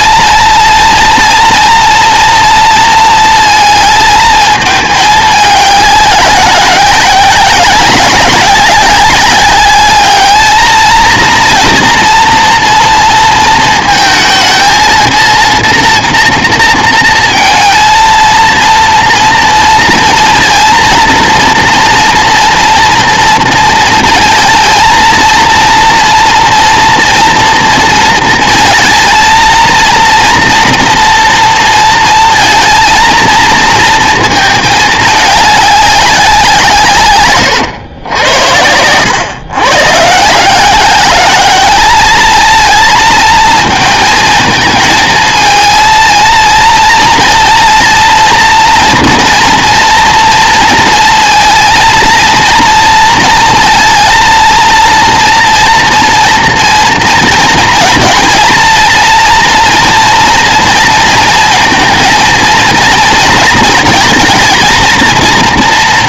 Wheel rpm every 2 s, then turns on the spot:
230, 230, 220, 190, 190, 220, 230, 230, 230, 230, 230, 230, 230, 240, 230, 230, 230, 220, 170, 100, 170, 230, 220, 230, 240, 230, 230, 230, 230, 220, 230, 230, 220.
none